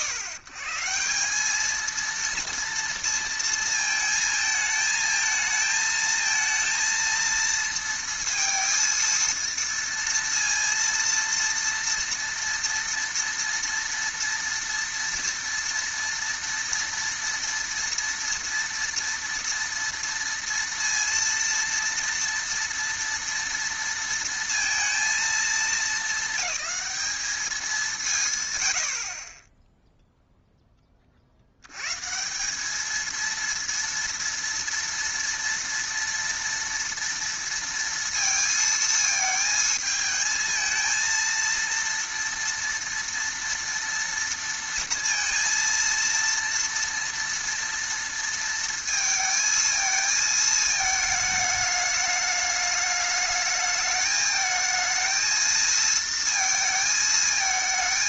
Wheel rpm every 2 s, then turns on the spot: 130, 230, 220, 230, 230, 230, 230, 230, 230, 240, 230, 230, 230, 200, 100, 20, 200, 230, 230, 220, 220, 230, 230, 230, 230, 220, 210, 220, 230.
none